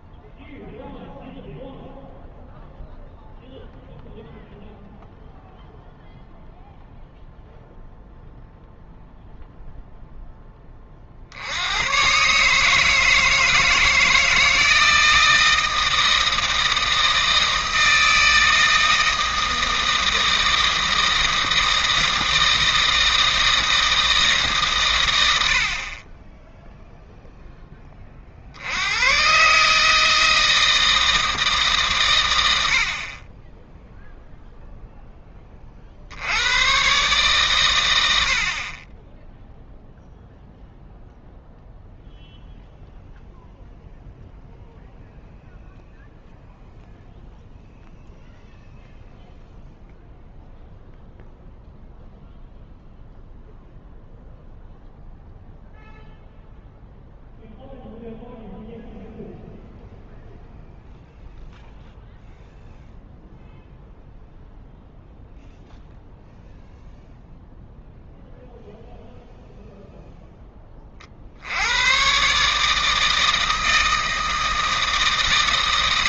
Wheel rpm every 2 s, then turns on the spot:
0, 0, 0, 0, 0, 20, 160, 160, 160, 160, 160, 160, 120, 0, 100, 160, 70, 0, 130, 20, 0, 0, 0, 0, 0, 0, 0, 0, 0, 0, 0, 0, 0, 0, 0, 30, 160, 160.
none